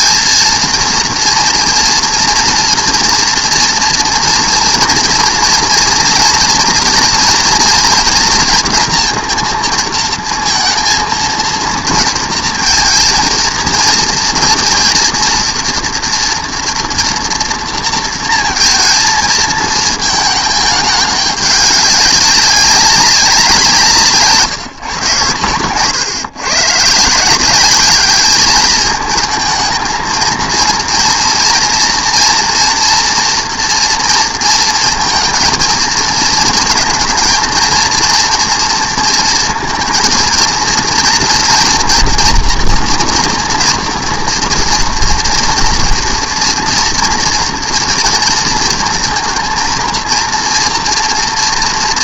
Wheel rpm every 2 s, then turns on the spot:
230, 230, 230, 240, 240, 230, 230, 230, 230, 230, 210, 190, 150, 130, 210, 230, 230, 230, 220, 230, 230, 240, 230, 230, 230, 230.
none